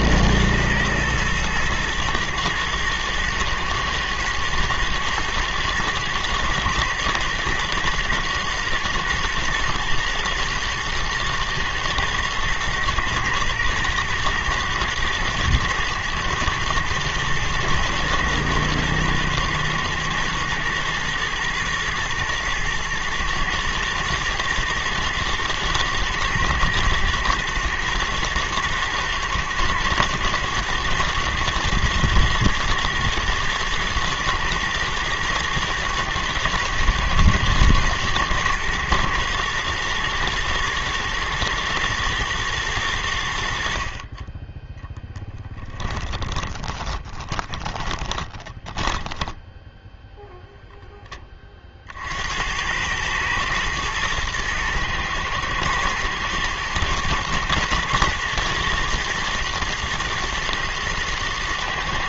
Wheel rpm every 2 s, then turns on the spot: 120, 110, 110, 120, 120, 120, 120, 110, 110, 110, 110, 110, 120, 110, 110, 110, 120, 110, 120, 120, 120, 110, 10, 20, 10, 0, 90, 110, 110, 120, 110.
46-50